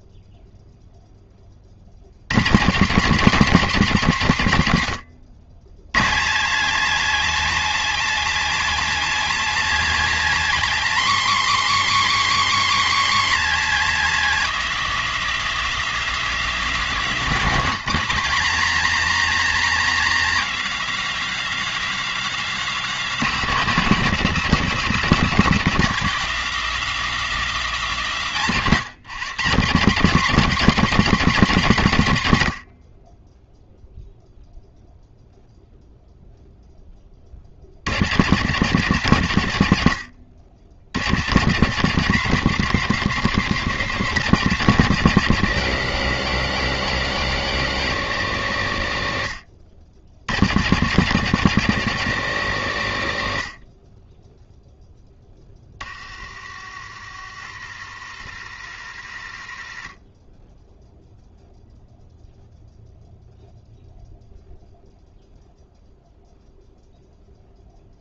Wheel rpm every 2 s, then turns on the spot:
0, 160, 140, 220, 260, 260, 260, 260, 240, 250, 260, 260, 250, 260, 190, 240, 80, 0, 0, 170, 100, 190, 190, 190, 150, 150, 160, 0, 50, 60, 10, 0, 0, 0.
none